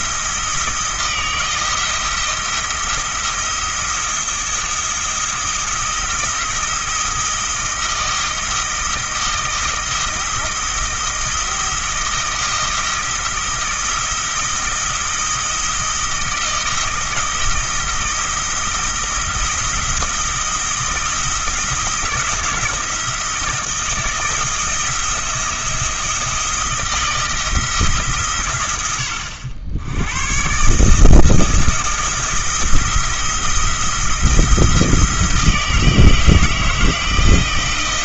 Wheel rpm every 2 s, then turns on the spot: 160, 170, 170, 170, 170, 160, 160, 160, 160, 160, 160, 170, 170, 170, 100, 150, 170, 160, 160.
none